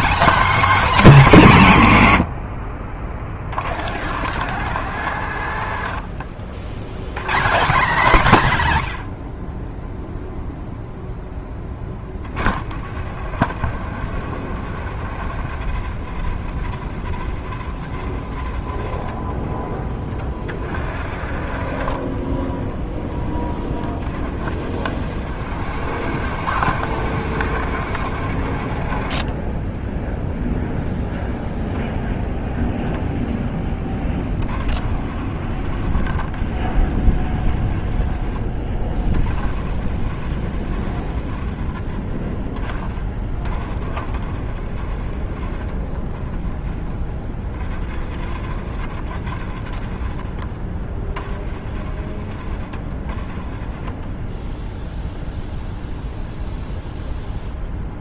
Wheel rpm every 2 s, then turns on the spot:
260, 50, 110, 170, 70, 10, 60, 70, 70, 40, 50, 30, 60, 60, 20, 0, 20, 50, 50, 30, 40, 40, 40, 30, 60, 30, 30, 0, 0.
2-6